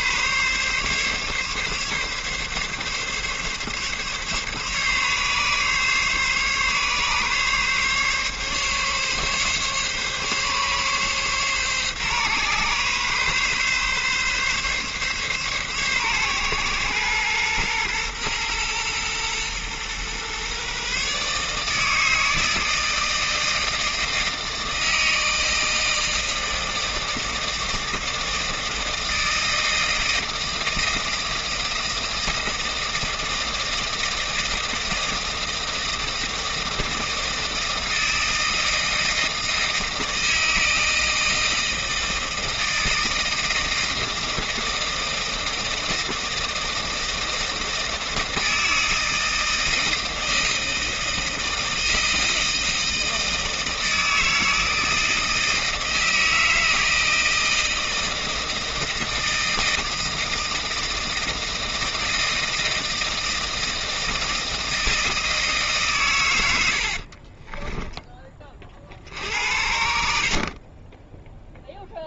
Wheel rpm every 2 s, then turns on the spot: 140, 140, 140, 140, 140, 140, 140, 140, 130, 120, 120, 160, 160, 160, 160, 160, 160, 160, 160, 160, 160, 160, 160, 160, 160, 160, 160, 160, 160, 160, 160, 170, 160, 110, 20, 60.
none